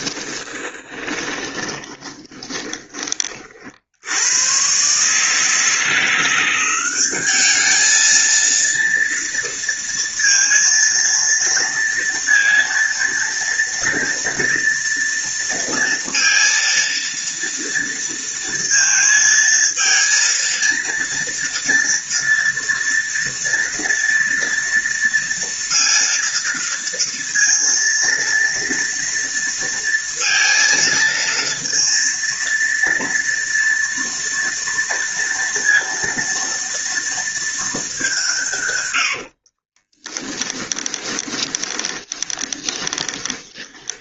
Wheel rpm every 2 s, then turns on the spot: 20, 20, 130, 190, 230, 230, 230, 230, 230, 230, 230, 230, 230, 230, 230, 230, 230, 230, 230, 100, 20, 30.
0-2 38-44